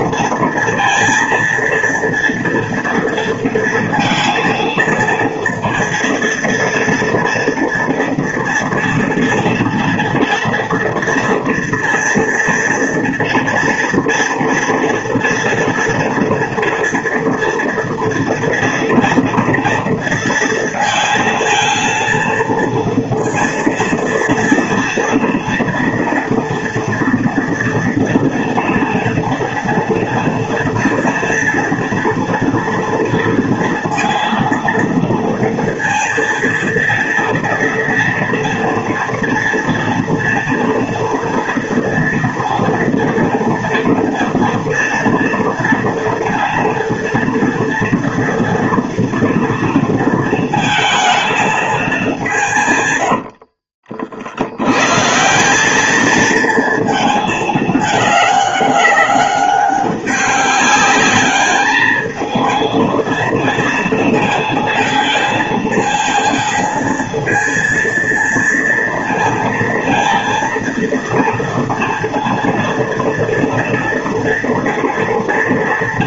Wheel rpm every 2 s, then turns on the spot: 230, 230, 230, 230, 230, 230, 230, 230, 230, 230, 230, 230, 230, 240, 230, 230, 230, 230, 230, 230, 230, 240, 230, 230, 230, 220, 110, 130, 220, 200, 200, 230, 230, 230, 230, 230, 230, 230.
none